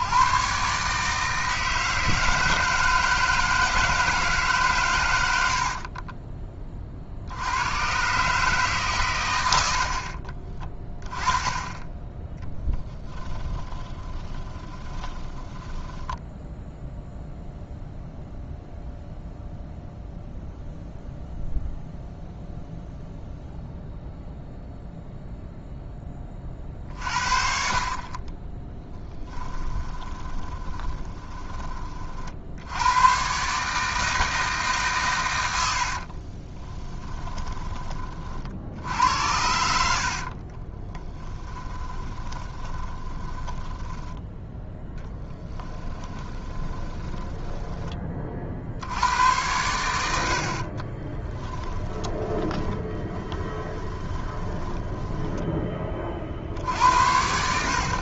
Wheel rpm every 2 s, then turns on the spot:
120, 160, 150, 20, 140, 30, 10, 20, 0, 0, 0, 0, 0, 40, 20, 30, 70, 150, 30, 60, 30, 20, 10, 20, 40, 60, 20, 20, 50.
12-16 30-32 36-38 40-44 46-48 52-56